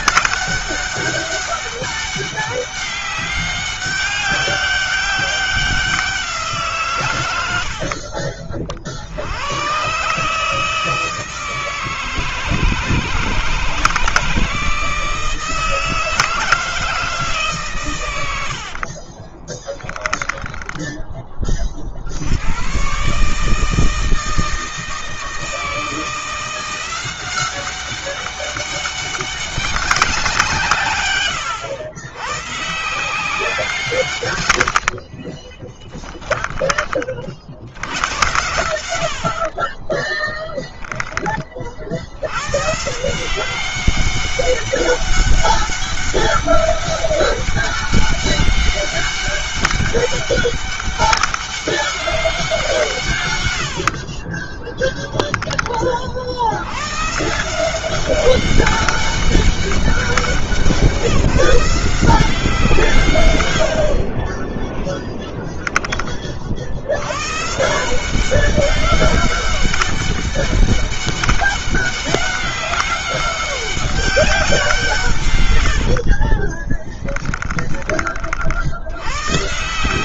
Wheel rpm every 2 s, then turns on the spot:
200, 200, 190, 120, 70, 160, 160, 160, 160, 50, 20, 140, 160, 180, 200, 130, 160, 40, 40, 80, 20, 160, 200, 200, 200, 200, 150, 10, 130, 200, 180, 140, 10, 100, 200, 200, 200, 150, 20, 100.
18-20 34-36 38-40 76-78